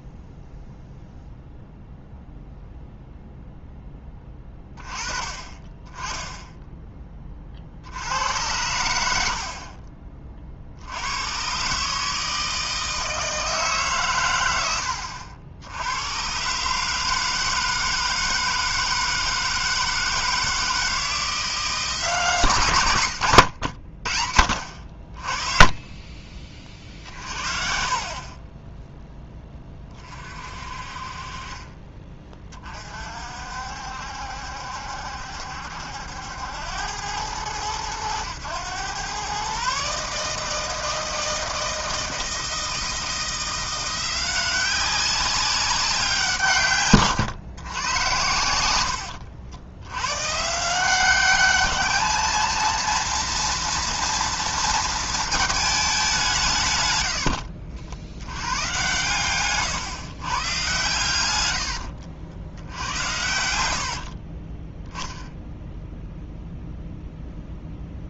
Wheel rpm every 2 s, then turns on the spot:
0, 0, 20, 10, 90, 80, 160, 80, 150, 160, 160, 110, 50, 30, 10, 50, 40, 70, 90, 120, 160, 170, 190, 130, 80, 180, 230, 230, 100, 120, 120, 80, 0, 0.
48-50